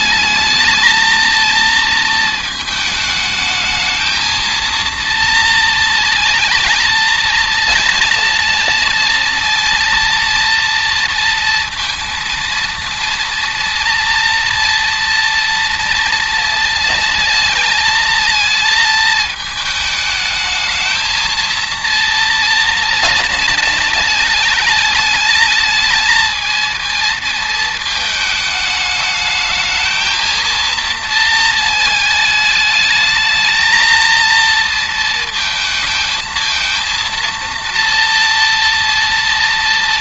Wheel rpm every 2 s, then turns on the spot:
230, 220, 230, 230, 230, 230, 230, 230, 230, 220, 220, 230, 220, 230, 210, 230, 220, 230, 230, 230.
none